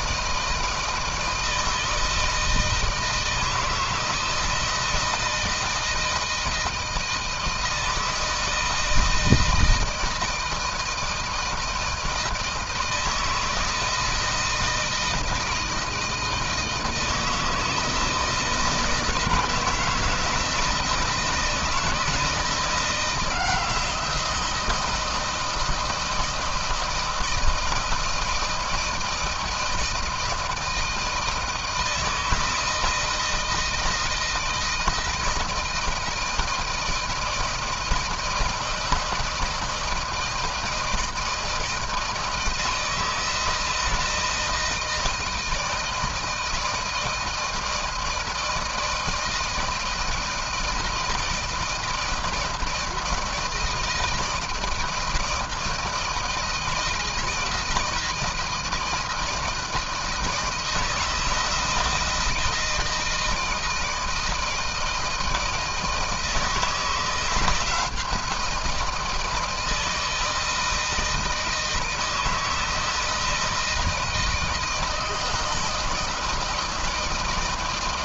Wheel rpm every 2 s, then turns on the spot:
160, 160, 160, 160, 160, 160, 160, 160, 160, 170, 170, 170, 170, 160, 160, 160, 160, 160, 160, 160, 160, 160, 160, 170, 160, 160, 160, 160, 160, 160, 160, 160, 160, 160, 170, 160, 160, 160, 160.
none